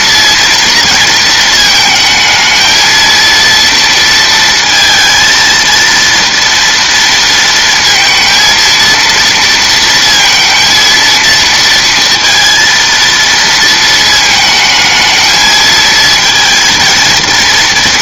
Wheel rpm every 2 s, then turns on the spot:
230, 220, 220, 230, 230, 230, 230, 220, 230.
none